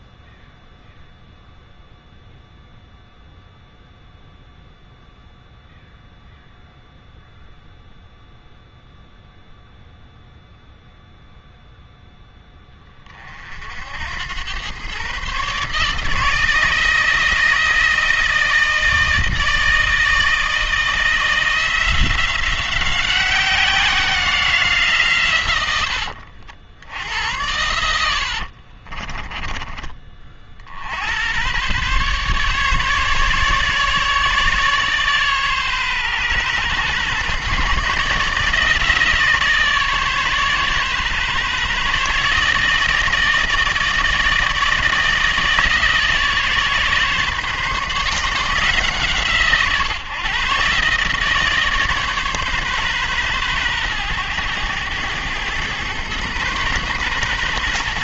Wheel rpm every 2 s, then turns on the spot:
0, 0, 0, 0, 0, 0, 20, 110, 160, 160, 160, 180, 160, 70, 50, 60, 140, 140, 130, 150, 140, 160, 160, 140, 160, 140, 130, 110, 120.
28-30